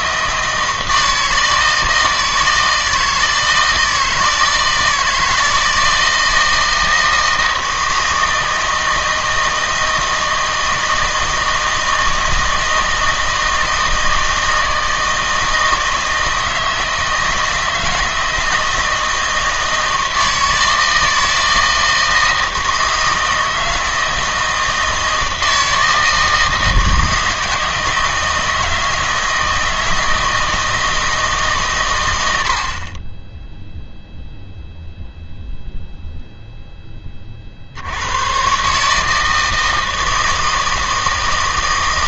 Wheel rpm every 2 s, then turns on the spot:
160, 160, 160, 160, 160, 160, 160, 160, 160, 160, 160, 160, 160, 160, 160, 160, 50, 0, 10, 150, 160.
none